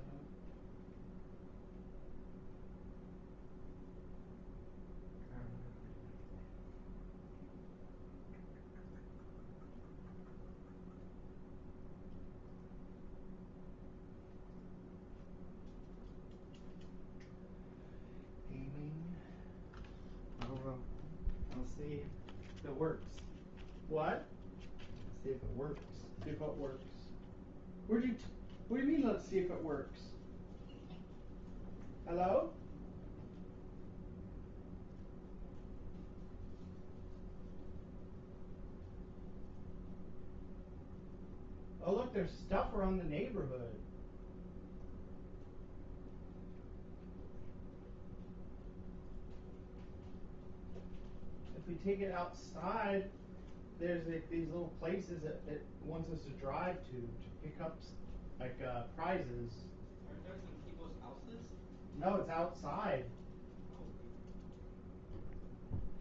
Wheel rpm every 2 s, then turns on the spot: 0, 0, 0, 0, 0, 0, 0, 0, 0, 0, 0, 0, 0, 0, 0, 0, 0, 0, 0, 0, 0, 0, 0, 0, 0, 0, 0, 0, 0, 0, 0, 0, 0.
none